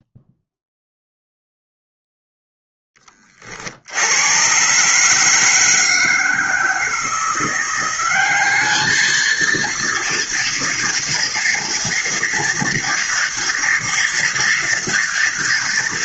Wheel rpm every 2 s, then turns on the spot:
0, 20, 150, 170, 220, 240, 230, 230.
none